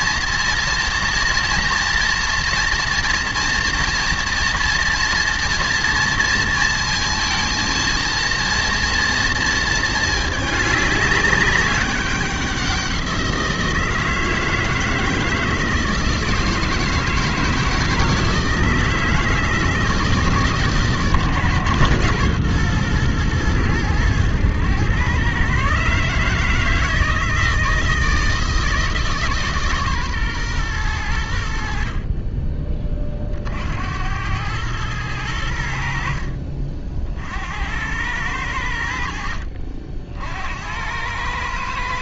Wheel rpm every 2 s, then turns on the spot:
240, 230, 230, 230, 230, 210, 190, 160, 160, 160, 150, 120, 110, 150, 160, 120, 30, 110, 50, 90, 80.
none